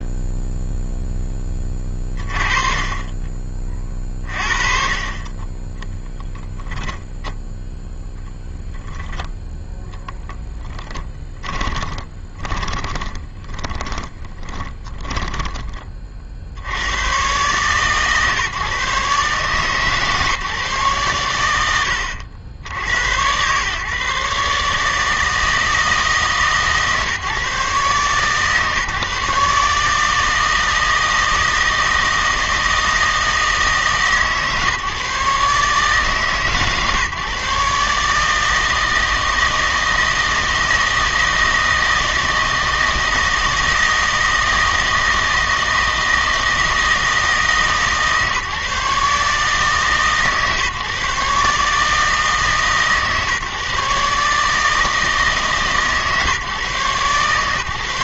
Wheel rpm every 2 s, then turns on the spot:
0, 30, 40, 0, 10, 10, 20, 20, 70, 140, 130, 90, 150, 140, 140, 160, 160, 150, 140, 160, 160, 160, 160, 160, 150, 140, 150, 150, 130.
12-16